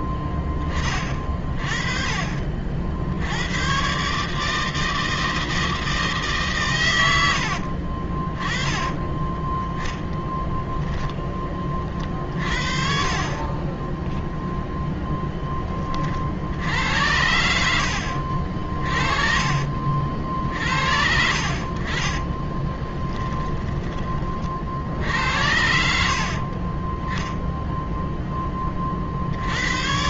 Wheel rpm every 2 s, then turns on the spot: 20, 40, 140, 150, 30, 10, 50, 10, 60, 50, 60, 20, 40, 50, 10.
10-12 22-24